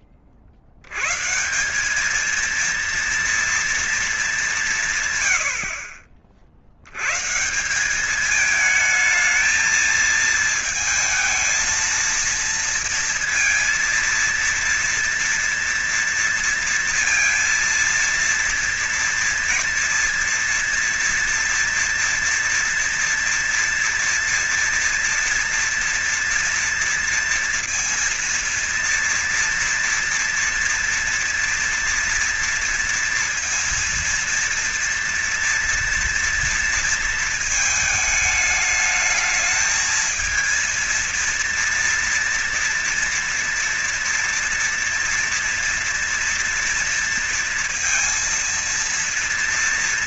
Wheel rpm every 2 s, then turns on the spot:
70, 230, 190, 90, 220, 220, 230, 230, 230, 230, 230, 230, 230, 230, 230, 230, 230, 230, 230, 210, 230, 230, 230, 230, 230.
none